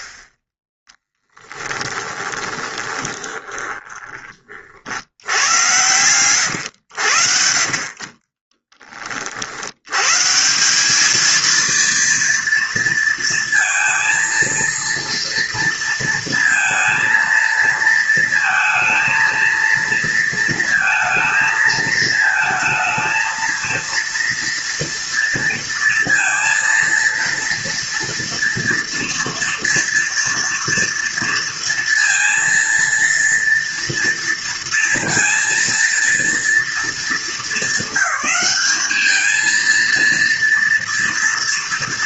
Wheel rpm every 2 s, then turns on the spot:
20, 20, 50, 100, 30, 170, 230, 230, 230, 230, 230, 220, 230, 230, 230, 230, 230, 230, 220, 200, 230.
2-4 8-10